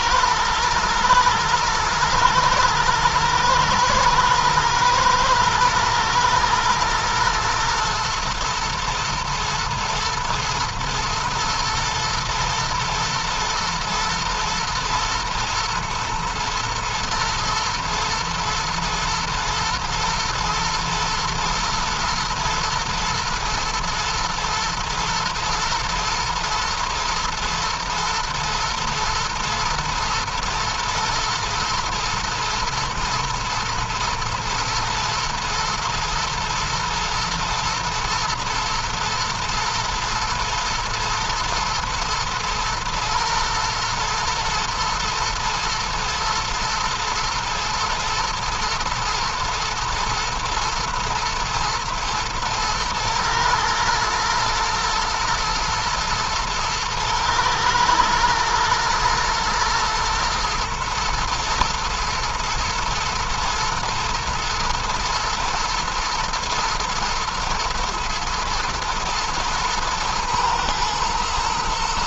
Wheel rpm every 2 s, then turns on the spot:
120, 110, 110, 110, 110, 110, 110, 120, 120, 120, 110, 120, 120, 120, 110, 120, 120, 110, 110, 120, 110, 120, 120, 110, 120, 120, 110, 120, 120, 110, 110, 110, 110, 110, 110, 120.
none